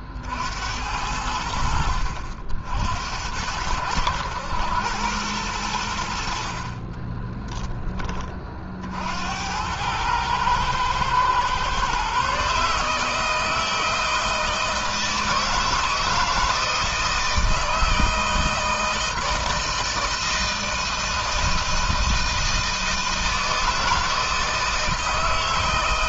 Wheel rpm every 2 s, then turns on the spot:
70, 60, 100, 50, 40, 110, 140, 160, 160, 160, 160, 160, 160.
6-8